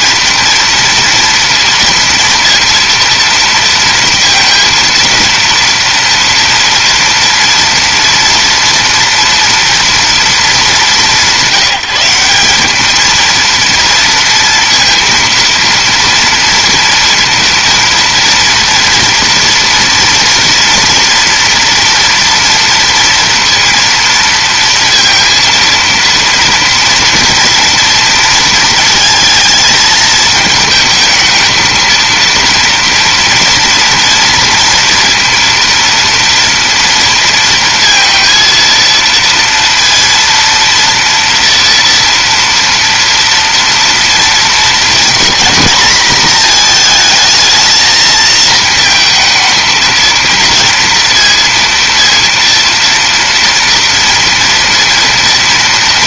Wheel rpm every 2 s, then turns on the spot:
230, 230, 230, 240, 230, 210, 210, 230, 230, 240, 230, 230, 230, 230, 220, 220, 230, 230, 230, 230, 230, 230, 220, 220, 220, 230, 230, 230.
none